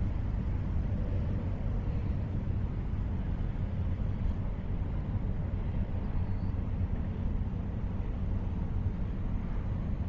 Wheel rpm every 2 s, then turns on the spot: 0, 0, 0, 0, 0.
none